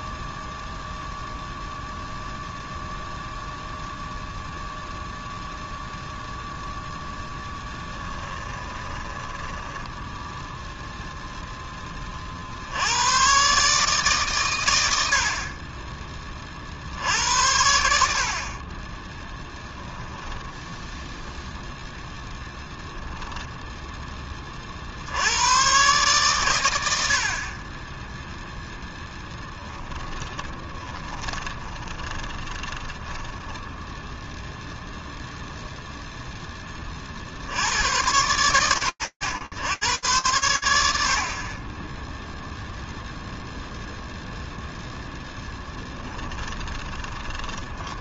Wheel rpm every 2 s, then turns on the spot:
0, 0, 0, 0, 20, 0, 60, 100, 40, 40, 10, 10, 40, 110, 0, 20, 20, 0, 20, 110, 10, 0, 0, 20.
8-10 20-24 30-34 46-48